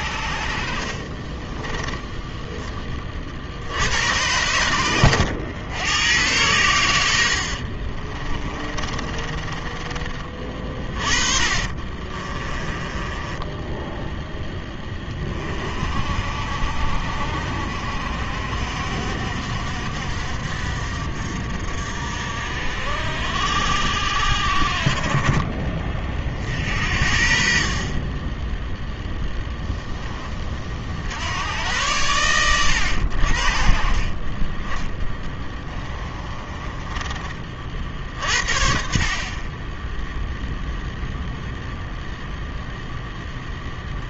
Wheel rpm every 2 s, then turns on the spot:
60, 10, 100, 90, 30, 30, 20, 10, 60, 60, 60, 60, 50, 60, 10, 40, 100, 20, 20, 40, 0, 0.
0-2 8-14 34-38